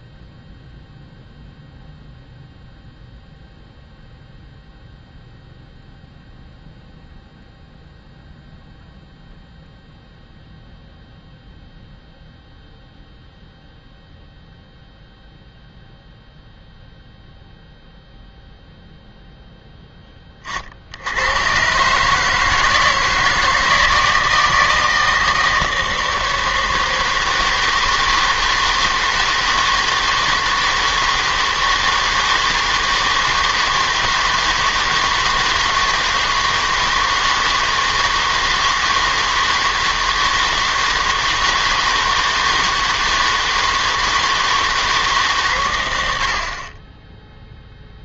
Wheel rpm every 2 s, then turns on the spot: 0, 0, 0, 0, 0, 0, 0, 0, 0, 0, 50, 160, 160, 160, 160, 160, 160, 160, 160, 160, 160, 160, 160, 30.
none